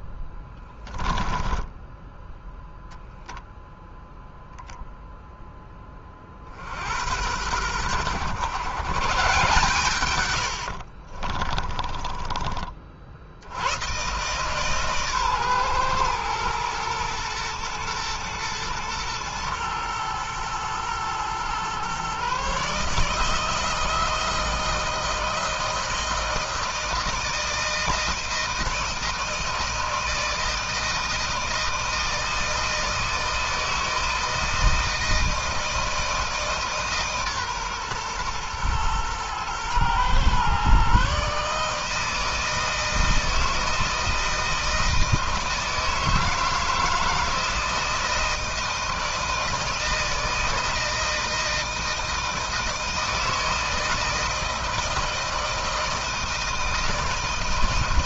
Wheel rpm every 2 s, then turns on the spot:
10, 0, 0, 80, 120, 60, 40, 140, 120, 120, 110, 150, 160, 160, 160, 160, 160, 160, 150, 120, 130, 160, 160, 160, 160, 160, 160, 160, 160.
0-2 10-12